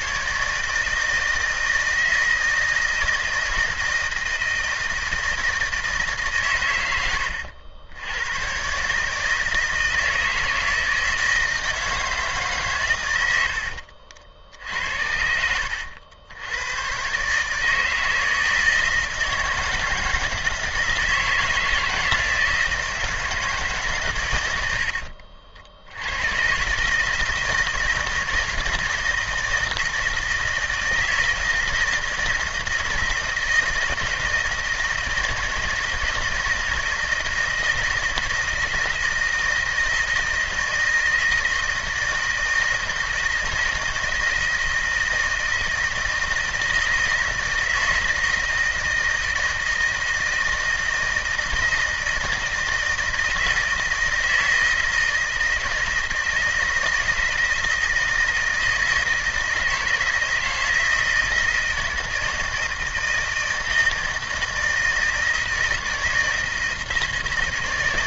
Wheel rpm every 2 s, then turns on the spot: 160, 160, 160, 120, 130, 160, 130, 70, 100, 160, 160, 160, 90, 130, 160, 160, 160, 160, 160, 160, 160, 160, 160, 160, 160, 160, 160, 160, 160, 160, 160, 160, 160, 160.
24-26